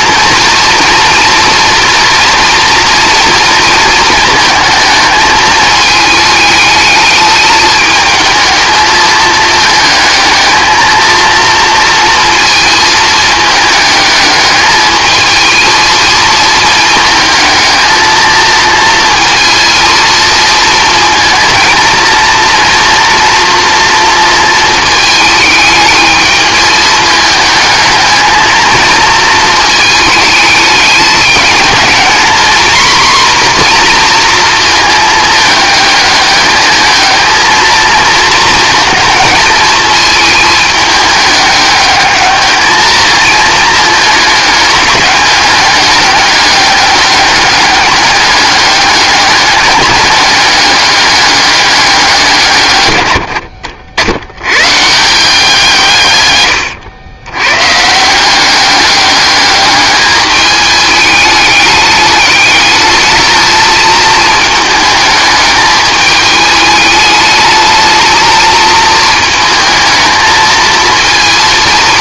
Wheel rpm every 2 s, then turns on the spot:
240, 230, 220, 210, 220, 220, 220, 220, 220, 230, 230, 230, 220, 210, 230, 210, 240, 220, 220, 220, 210, 220, 200, 200, 200, 200, 110, 150, 100, 200, 210, 220, 220, 220, 220, 230.
none